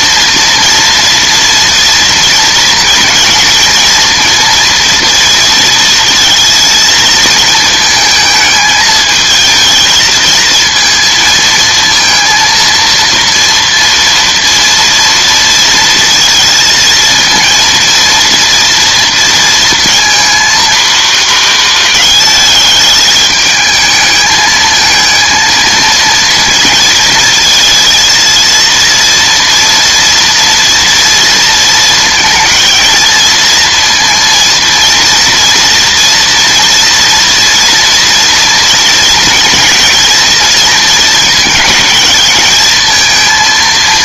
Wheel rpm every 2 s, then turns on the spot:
230, 230, 230, 230, 220, 230, 230, 230, 230, 230, 230, 210, 220, 230, 230, 230, 220, 230, 230, 230, 230, 220.
none